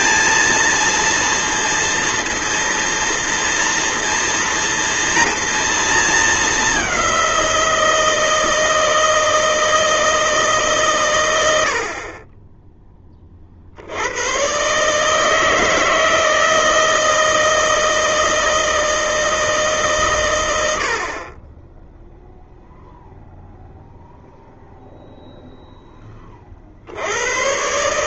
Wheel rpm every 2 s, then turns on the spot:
230, 230, 240, 210, 160, 150, 20, 130, 160, 160, 90, 0, 0, 50.
none